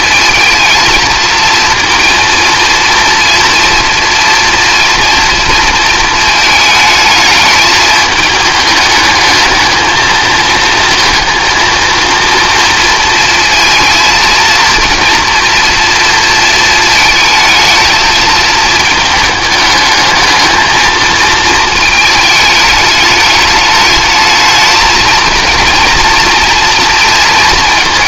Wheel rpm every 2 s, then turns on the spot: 220, 230, 230, 220, 210, 220, 230, 230, 220, 220, 220, 210, 220, 230.
none